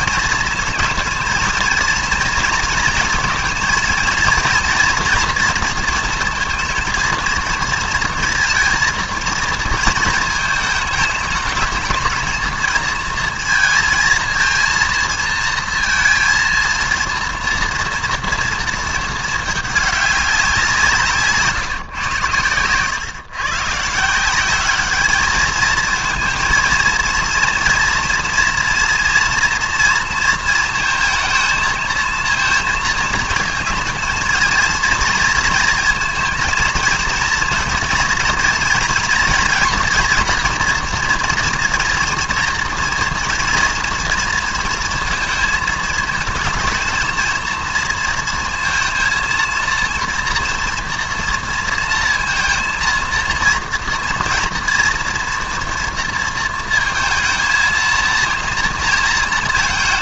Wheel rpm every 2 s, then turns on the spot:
230, 230, 230, 230, 230, 220, 220, 220, 230, 230, 180, 110, 190, 230, 240, 230, 220, 230, 230, 230, 230, 230, 230, 220, 230, 240, 230, 230, 220, 230.
none